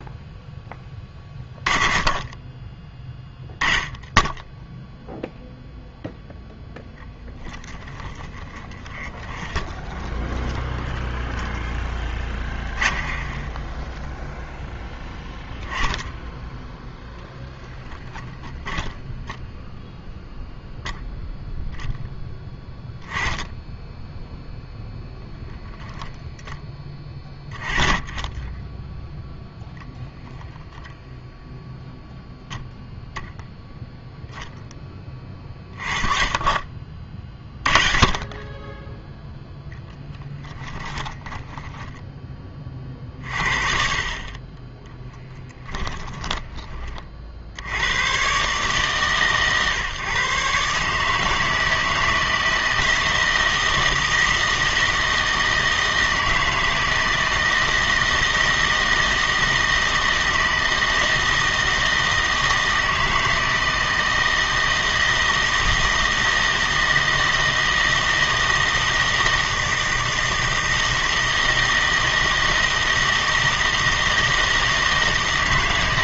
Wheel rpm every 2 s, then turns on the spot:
10, 20, 0, 0, 20, 10, 20, 10, 0, 10, 0, 10, 0, 10, 10, 0, 0, 10, 40, 20, 10, 30, 20, 20, 130, 140, 160, 160, 160, 160, 160, 160, 160, 160, 160, 160, 160, 160.
8-14 18-20 40-42